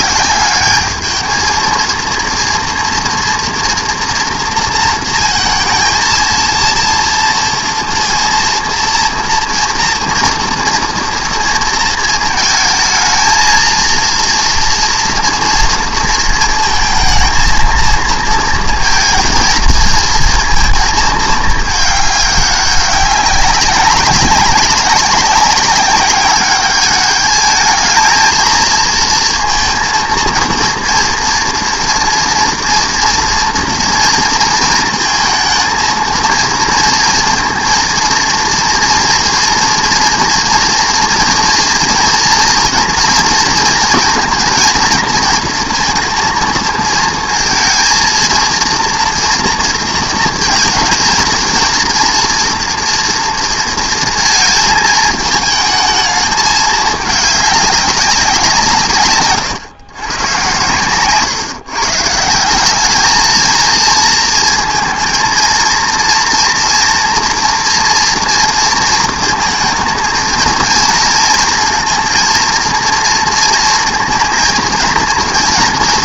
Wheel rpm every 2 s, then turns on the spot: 220, 230, 230, 230, 230, 230, 220, 230, 220, 230, 220, 200, 200, 220, 230, 240, 240, 220, 230, 230, 240, 230, 230, 230, 230, 230, 230, 220, 210, 130, 130, 220, 230, 230, 230, 230, 230, 240.
none